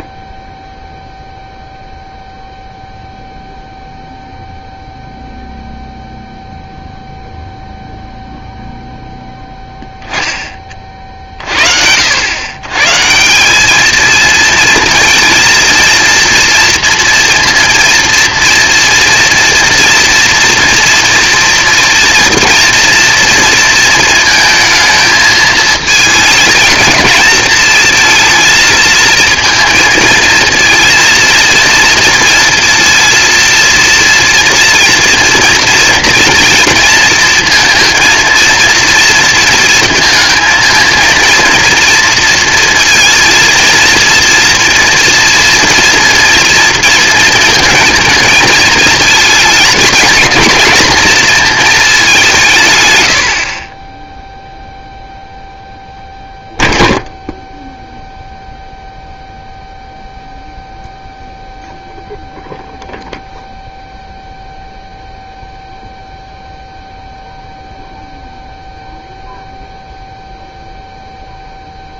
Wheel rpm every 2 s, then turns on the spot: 10, 0, 0, 0, 0, 30, 120, 230, 230, 230, 230, 230, 220, 220, 220, 230, 230, 230, 230, 230, 220, 230, 230, 230, 220, 230, 140, 0, 0, 0, 0, 0, 0, 0, 0, 0.
none